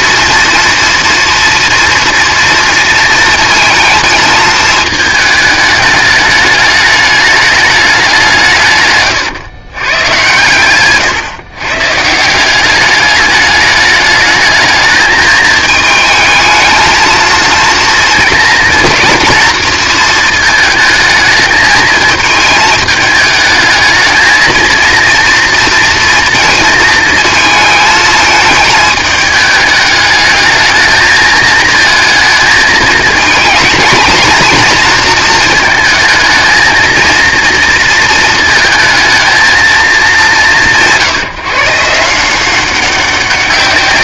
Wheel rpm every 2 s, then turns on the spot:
230, 230, 220, 210, 160, 120, 190, 220, 220, 230, 220, 220, 220, 230, 220, 220, 220, 230, 230, 220, 160, 180.
none